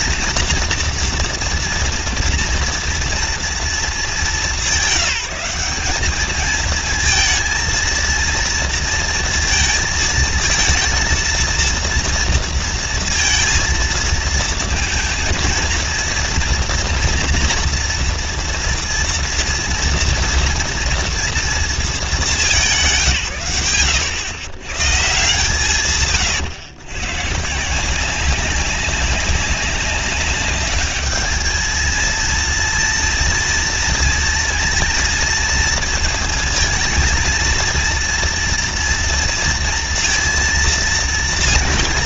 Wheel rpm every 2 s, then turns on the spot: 240, 240, 210, 210, 230, 230, 230, 230, 230, 230, 230, 180, 120, 120, 190, 200, 230, 230, 220, 230, 230.
none